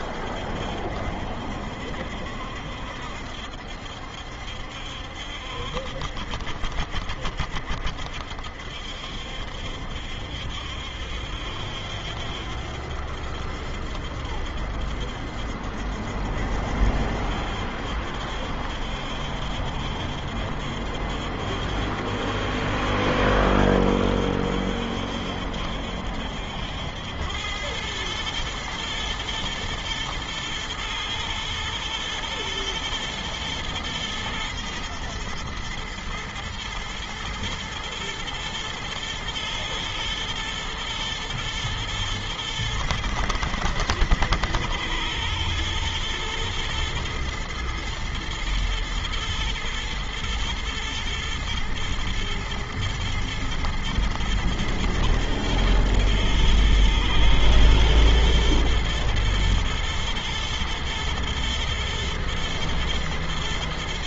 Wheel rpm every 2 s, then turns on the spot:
70, 70, 70, 70, 60, 70, 70, 70, 70, 70, 70, 70, 70, 70, 110, 120, 120, 110, 110, 110, 110, 110, 110, 120, 120, 120, 120, 120, 120, 110, 120, 110.
none